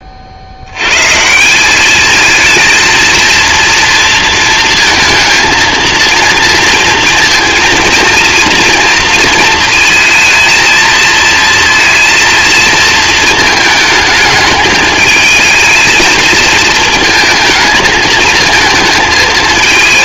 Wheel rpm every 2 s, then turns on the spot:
120, 230, 220, 230, 230, 230, 230, 210, 220, 220.
none